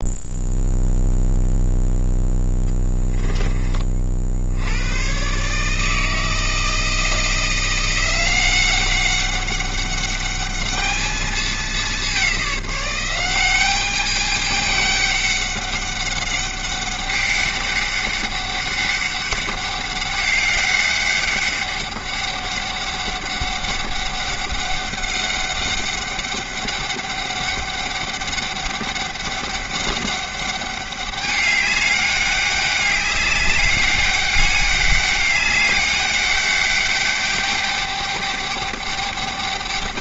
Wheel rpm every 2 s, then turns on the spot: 0, 10, 80, 160, 190, 210, 190, 210, 200, 200, 200, 200, 200, 200, 200, 200, 200, 200, 200, 210.
2-4